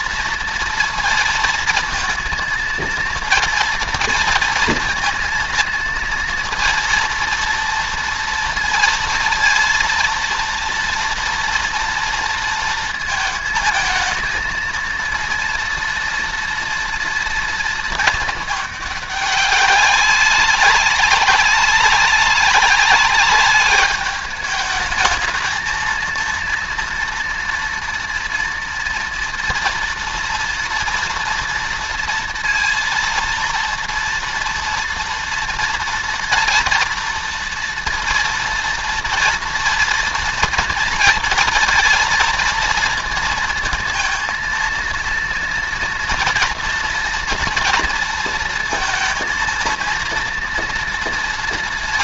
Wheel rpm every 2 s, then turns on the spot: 230, 230, 230, 230, 230, 240, 230, 230, 230, 210, 190, 190, 210, 230, 230, 240, 230, 230, 230, 230, 230, 230, 230, 230, 230, 230.
none